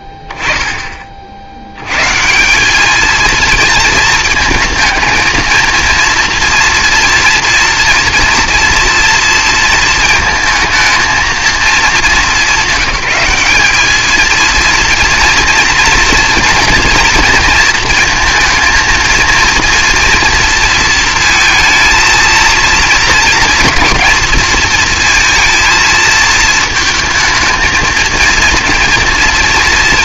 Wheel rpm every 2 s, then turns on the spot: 10, 180, 220, 230, 230, 220, 200, 230, 230, 230, 230, 230, 230, 220, 230.
none